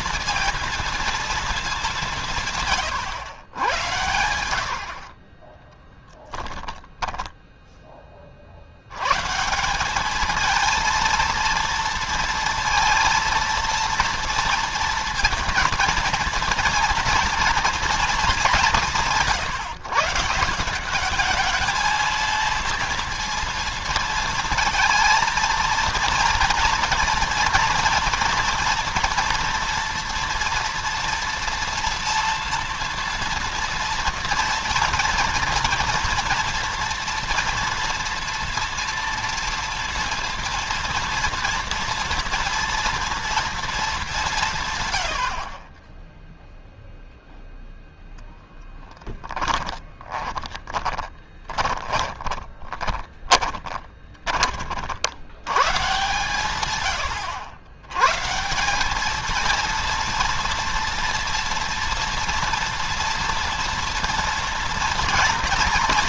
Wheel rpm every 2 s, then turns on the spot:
230, 150, 80, 10, 50, 220, 230, 230, 230, 200, 180, 230, 230, 230, 230, 230, 230, 230, 230, 230, 230, 230, 160, 0, 10, 30, 30, 30, 120, 140, 230, 230, 230.
2-4 6-8 48-54